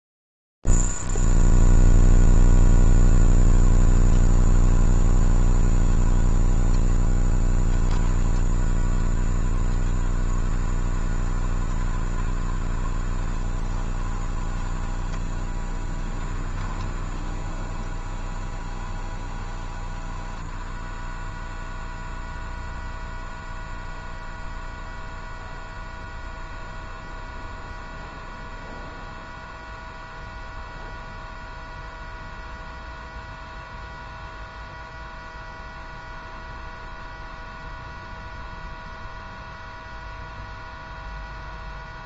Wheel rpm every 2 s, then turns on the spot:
0, 0, 10, 20, 10, 20, 20, 20, 20, 20, 10, 0, 0, 0, 0, 0, 0, 0, 0, 0, 0.
4-8 10-22